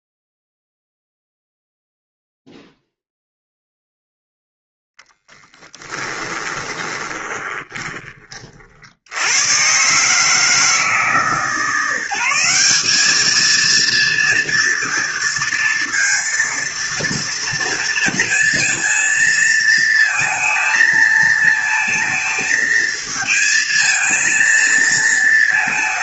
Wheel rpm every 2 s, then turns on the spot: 0, 0, 0, 20, 50, 150, 180, 240, 230, 230, 220, 230, 230.
6-8